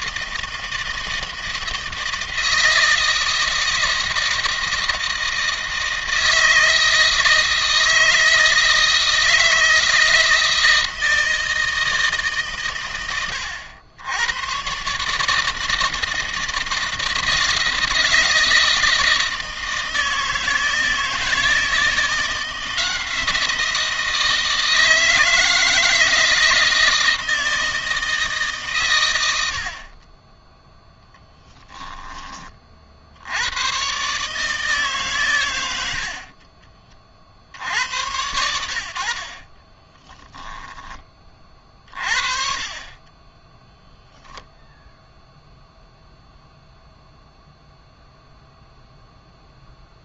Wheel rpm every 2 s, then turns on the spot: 160, 160, 160, 160, 160, 160, 140, 130, 160, 160, 160, 170, 160, 160, 130, 10, 30, 150, 30, 80, 10, 30, 0, 0, 0.
none